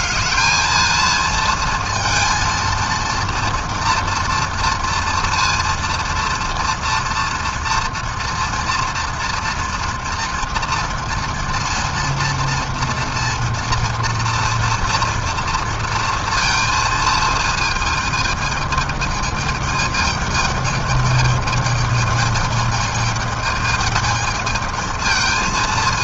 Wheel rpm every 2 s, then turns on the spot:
220, 230, 230, 230, 230, 230, 230, 230, 230, 220, 220, 210, 220.
none